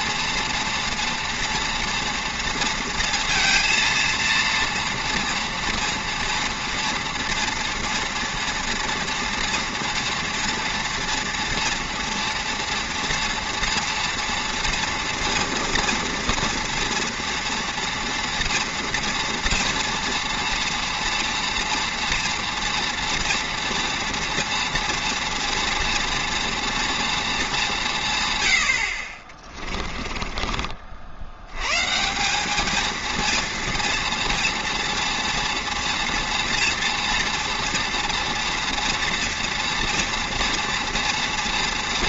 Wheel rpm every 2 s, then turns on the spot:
230, 230, 230, 230, 230, 230, 230, 240, 230, 240, 230, 230, 230, 230, 90, 40, 210, 230, 230, 230, 230.
none